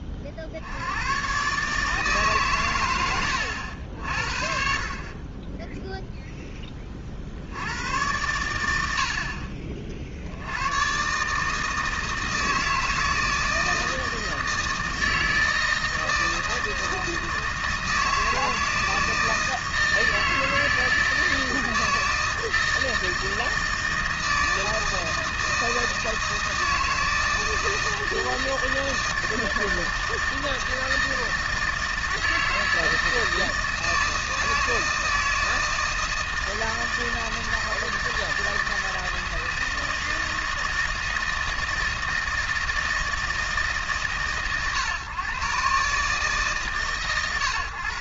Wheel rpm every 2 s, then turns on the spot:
50, 140, 50, 0, 110, 70, 160, 160, 160, 160, 160, 160, 160, 160, 160, 160, 160, 160, 160, 160, 160, 160, 120, 140.
none